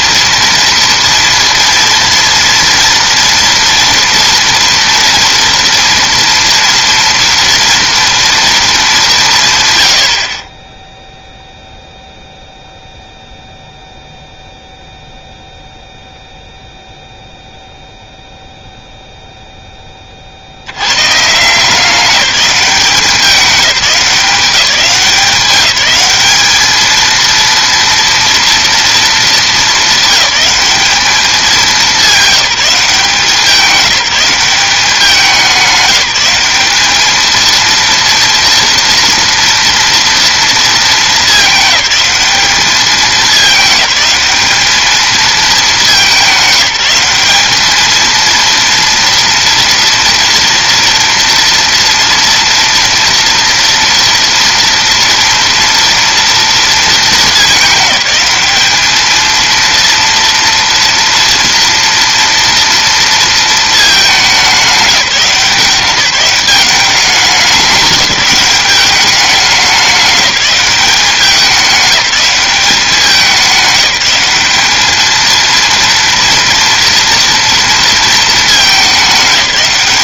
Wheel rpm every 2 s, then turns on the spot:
230, 230, 230, 240, 220, 10, 0, 0, 0, 0, 100, 190, 170, 220, 230, 210, 190, 190, 200, 230, 220, 210, 220, 200, 230, 230, 230, 230, 230, 210, 230, 230, 190, 190, 200, 190, 190, 210, 230, 210.
none